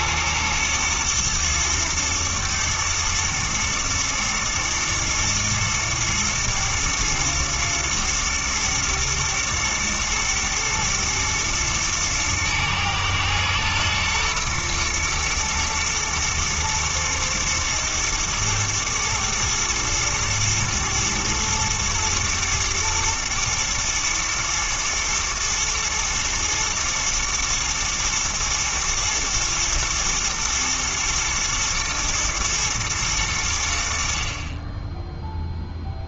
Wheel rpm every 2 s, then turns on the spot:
110, 110, 120, 120, 110, 110, 110, 120, 110, 110, 110, 120, 110, 110, 110, 120, 110, 20.
none